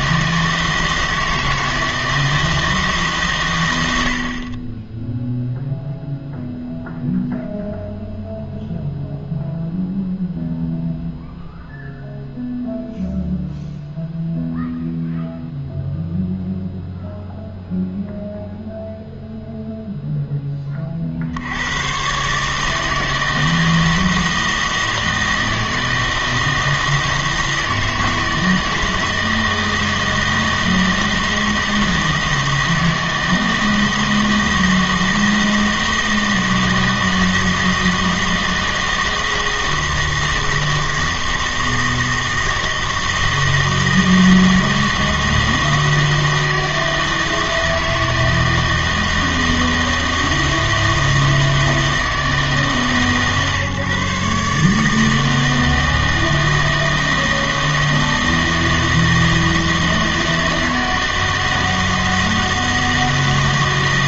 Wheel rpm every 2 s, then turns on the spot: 160, 160, 20, 0, 0, 0, 0, 0, 0, 0, 20, 150, 160, 160, 160, 160, 160, 160, 160, 160, 160, 160, 160, 160, 160, 160, 150, 150, 160, 160, 160, 160.
none